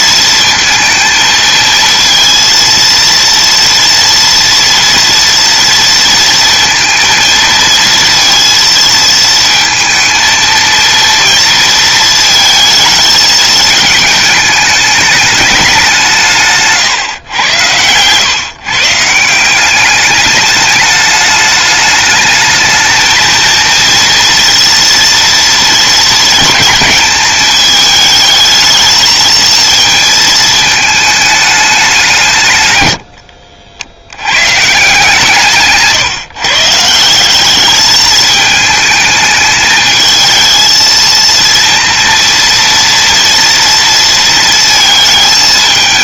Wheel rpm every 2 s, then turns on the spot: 220, 230, 230, 220, 220, 230, 220, 210, 130, 160, 210, 220, 230, 220, 220, 210, 70, 150, 180, 220, 230, 230, 220.
32-34